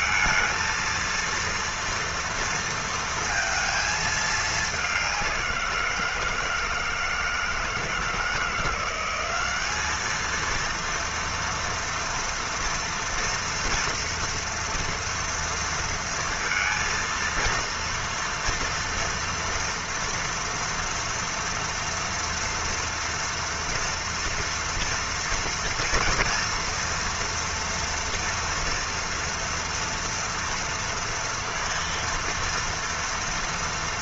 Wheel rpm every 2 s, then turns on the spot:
220, 230, 210, 170, 170, 220, 230, 230, 230, 230, 240, 230, 230, 230, 240, 230, 230.
none